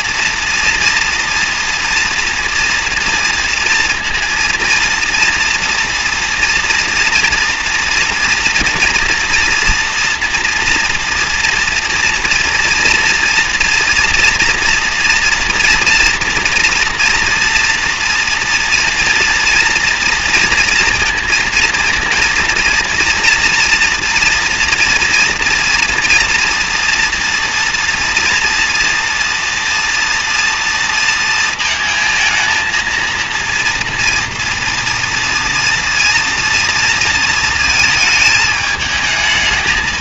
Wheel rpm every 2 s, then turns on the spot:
230, 230, 230, 230, 230, 240, 230, 230, 230, 230, 230, 230, 230, 230, 230, 230, 220, 230, 230, 210.
none